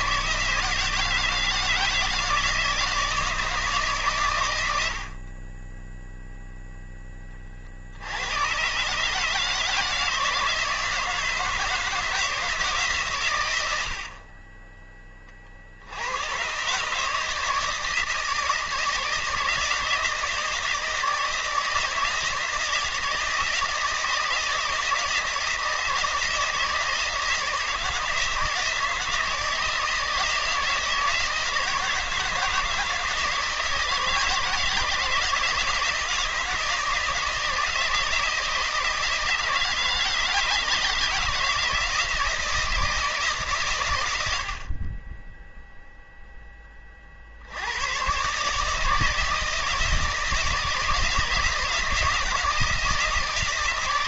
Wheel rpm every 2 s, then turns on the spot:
160, 170, 70, 10, 140, 160, 140, 20, 140, 160, 160, 170, 160, 160, 160, 160, 160, 160, 160, 160, 160, 160, 30, 40, 160, 160, 160.
none